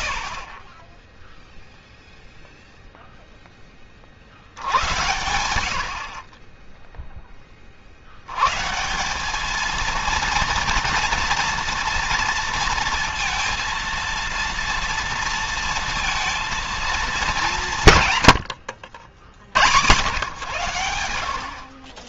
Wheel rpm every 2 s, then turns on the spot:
0, 10, 90, 10, 190, 230, 230, 230, 200, 70, 60.
none